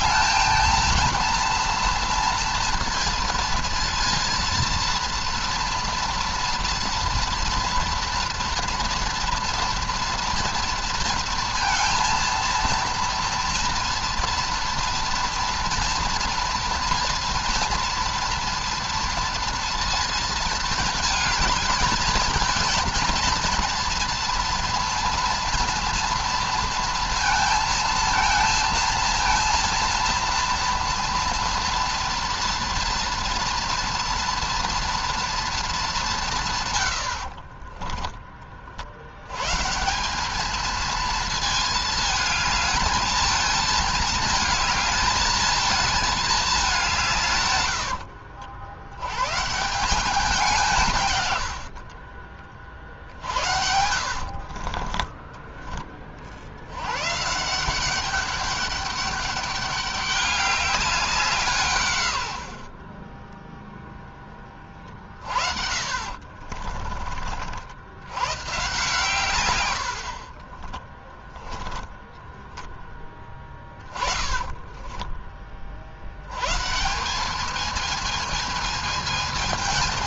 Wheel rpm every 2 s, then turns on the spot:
230, 230, 230, 240, 230, 230, 230, 230, 240, 230, 220, 220, 230, 230, 230, 230, 230, 230, 140, 40, 220, 220, 220, 200, 80, 180, 40, 40, 100, 200, 200, 70, 20, 50, 130, 30, 10, 10, 130, 220.
54-56 62-64 66-68 70-72 74-76